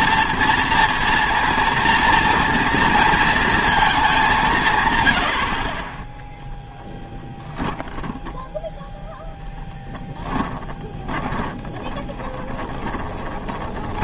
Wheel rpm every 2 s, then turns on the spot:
240, 230, 150, 0, 0, 20, 20.
10-14